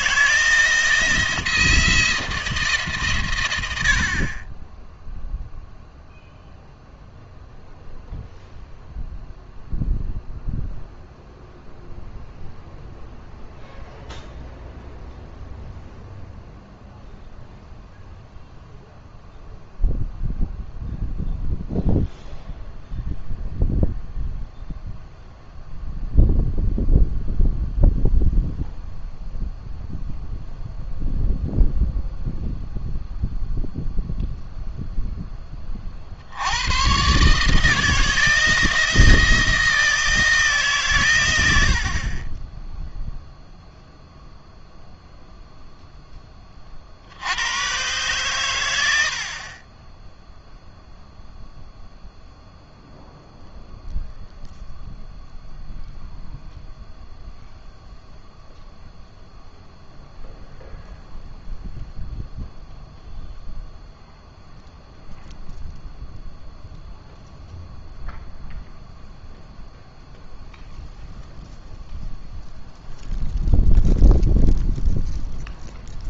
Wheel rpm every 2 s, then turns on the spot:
170, 160, 10, 0, 0, 0, 0, 0, 0, 0, 0, 0, 0, 0, 0, 0, 0, 0, 100, 170, 150, 10, 0, 40, 100, 0, 0, 0, 0, 0, 0, 0, 0, 0, 0, 0, 0, 0.
none